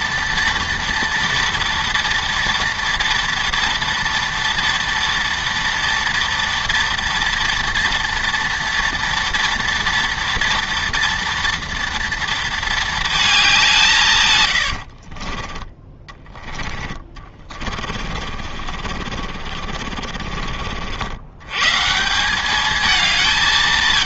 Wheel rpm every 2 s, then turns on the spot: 230, 230, 230, 230, 230, 230, 230, 90, 20, 50, 60, 210.
14-20